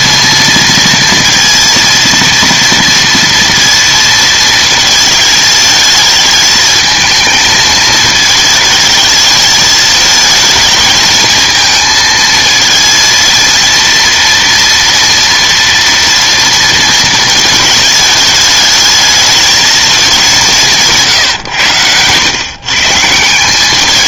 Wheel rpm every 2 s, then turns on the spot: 230, 230, 220, 220, 220, 220, 220, 230, 230, 220, 170, 130.
none